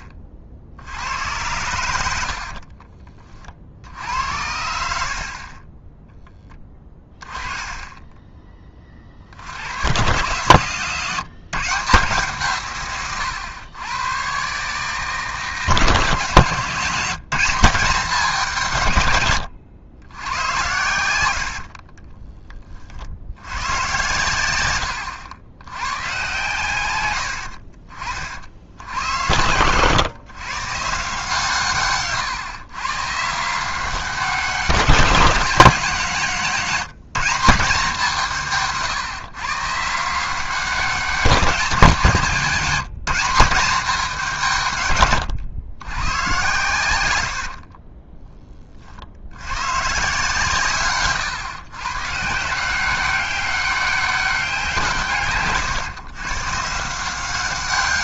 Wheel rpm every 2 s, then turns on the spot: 60, 50, 70, 10, 20, 130, 140, 140, 160, 150, 100, 30, 110, 120, 60, 130, 130, 180, 180, 160, 180, 180, 150, 100, 30, 140, 170, 180, 150.
2-6 20-22